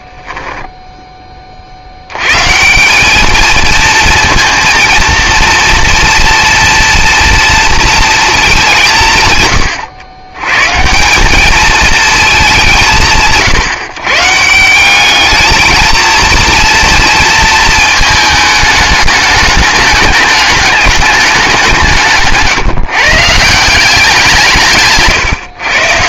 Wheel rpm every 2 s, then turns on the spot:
10, 150, 230, 230, 200, 130, 190, 170, 230, 220, 210, 150, 160.
0-2